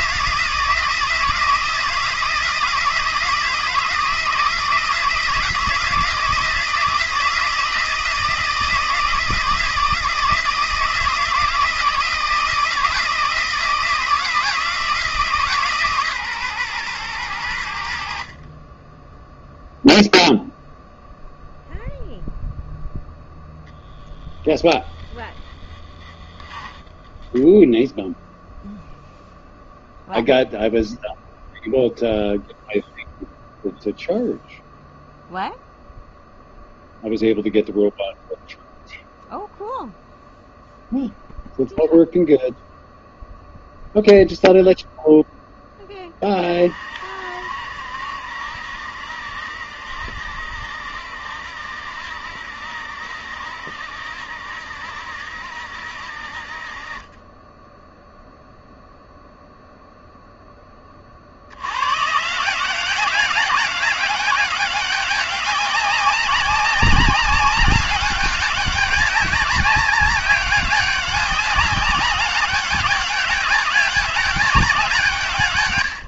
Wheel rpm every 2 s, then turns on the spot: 160, 160, 160, 160, 160, 160, 160, 160, 120, 20, 0, 0, 10, 10, 0, 0, 0, 0, 0, 0, 0, 0, 0, 40, 70, 70, 60, 70, 40, 0, 10, 180, 190, 190, 200, 200, 200, 190.
24-28